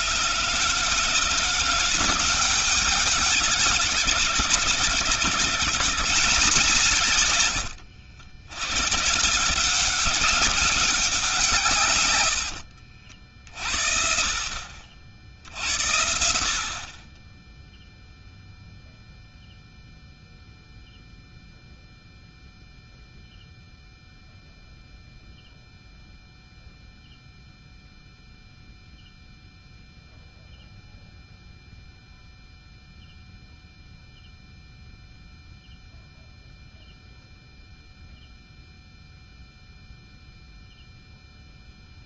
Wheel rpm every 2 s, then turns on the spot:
160, 200, 160, 140, 120, 180, 60, 60, 40, 0, 0, 0, 0, 0, 0, 0, 0, 0, 0, 0, 0.
none